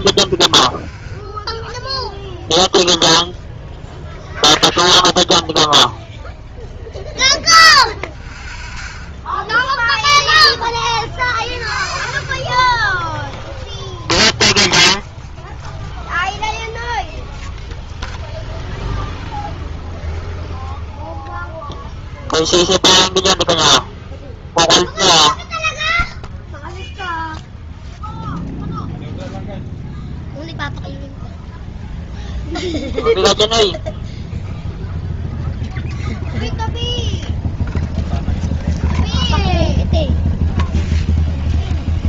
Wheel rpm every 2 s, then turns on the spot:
0, 0, 0, 0, 0, 0, 0, 0, 0, 0, 0, 0, 0, 0, 0, 0, 0, 0, 0, 0, 0.
none